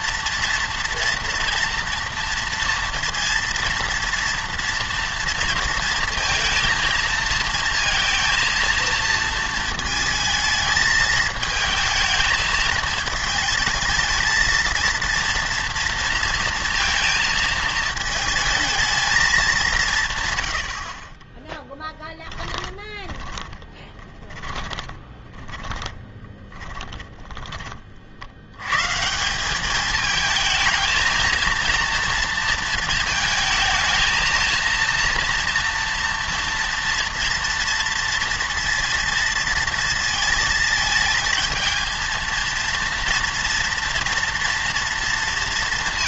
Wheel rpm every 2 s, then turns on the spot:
230, 230, 230, 230, 230, 220, 220, 230, 230, 220, 90, 20, 20, 20, 110, 220, 230, 230, 230, 230, 220, 230, 230.
22-28